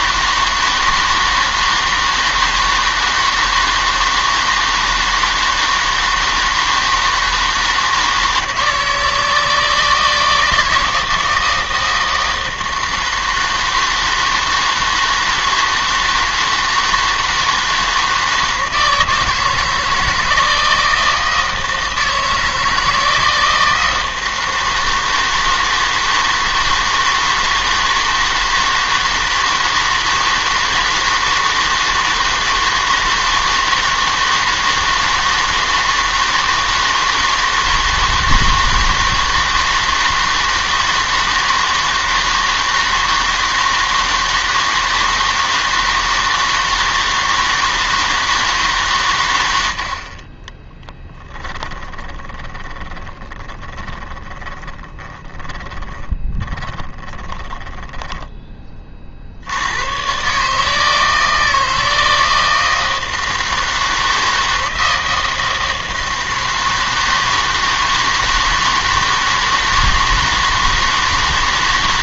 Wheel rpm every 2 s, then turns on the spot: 160, 160, 160, 160, 160, 160, 160, 160, 160, 160, 160, 160, 160, 160, 160, 160, 160, 160, 160, 160, 160, 160, 160, 160, 150, 10, 20, 20, 20, 20, 150, 160, 160, 160, 160, 160.
50-58